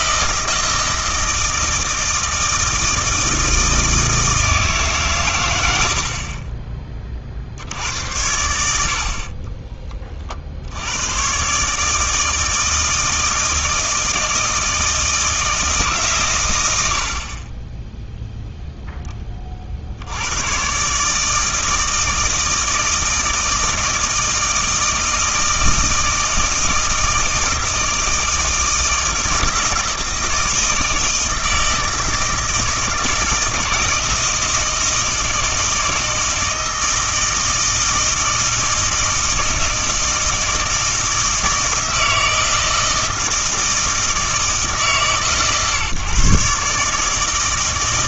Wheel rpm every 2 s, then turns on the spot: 160, 160, 150, 30, 70, 80, 160, 160, 90, 0, 120, 160, 160, 160, 160, 160, 160, 160, 160, 160, 160, 160, 150, 140.
none